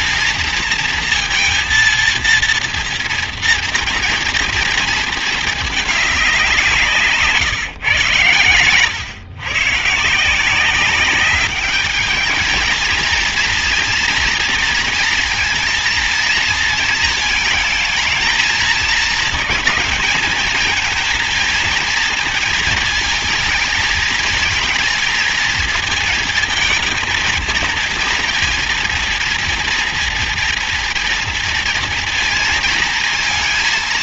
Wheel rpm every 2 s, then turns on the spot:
230, 230, 230, 170, 120, 180, 220, 230, 230, 220, 220, 230, 220, 220, 230, 230, 230.
none